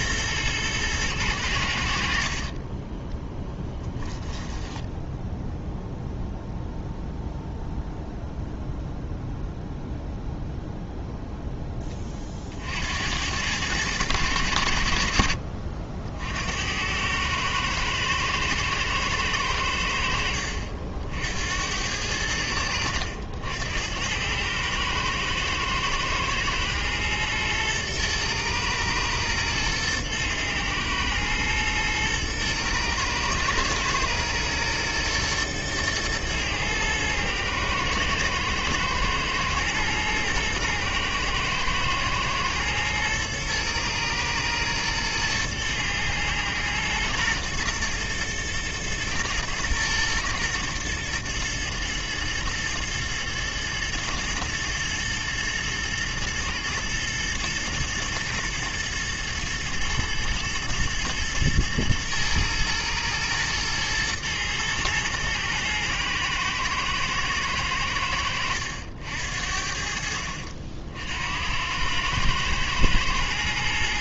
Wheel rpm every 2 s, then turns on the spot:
110, 30, 10, 0, 0, 0, 70, 80, 90, 110, 60, 80, 110, 120, 110, 110, 110, 120, 110, 110, 110, 120, 110, 110, 110, 120, 110, 120, 120, 110, 110, 120, 110, 110, 80, 60, 110.
2-6